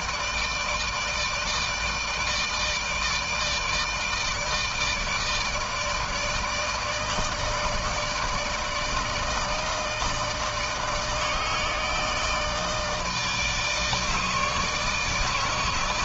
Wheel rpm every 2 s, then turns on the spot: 160, 160, 160, 160, 160, 160, 160, 150.
none